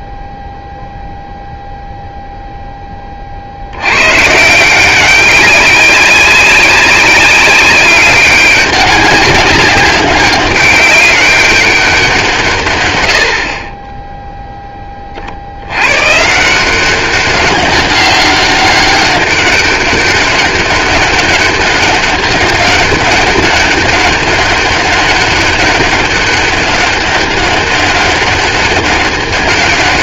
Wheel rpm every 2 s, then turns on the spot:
0, 0, 170, 190, 190, 190, 160, 10, 170, 200, 200, 200, 200, 200, 200.
none